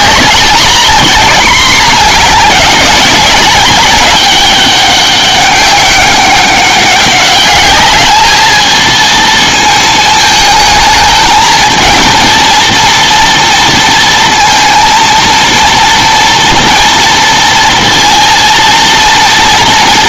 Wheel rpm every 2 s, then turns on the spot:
210, 210, 200, 200, 220, 220, 230, 230, 230, 230.
none